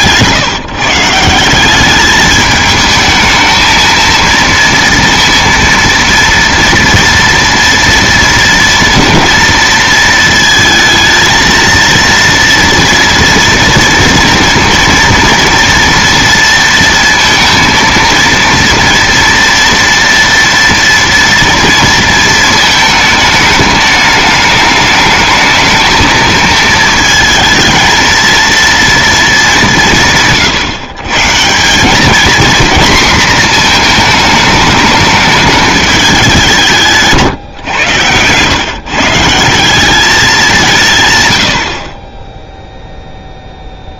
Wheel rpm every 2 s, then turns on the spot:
160, 220, 230, 230, 230, 220, 230, 230, 230, 230, 240, 220, 210, 220, 230, 150, 230, 210, 180, 130, 170, 0.
none